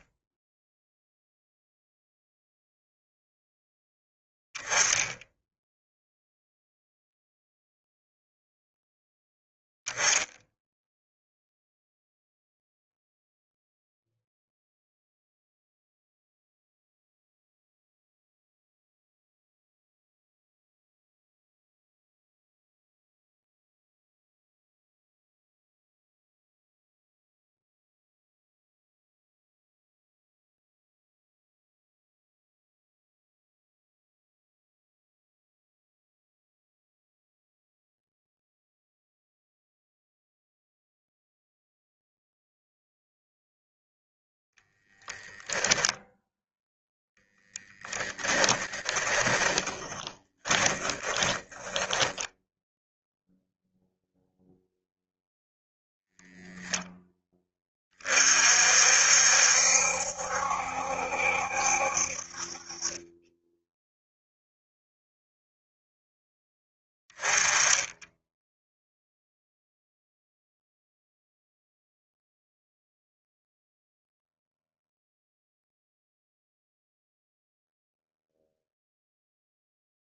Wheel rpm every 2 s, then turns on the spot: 0, 0, 10, 0, 0, 0, 0, 0, 0, 0, 0, 0, 0, 0, 0, 0, 0, 0, 0, 0, 0, 0, 10, 0, 20, 20, 0, 0, 10, 60, 70, 30, 0, 10, 0, 0, 0, 0, 0, 0.
48-52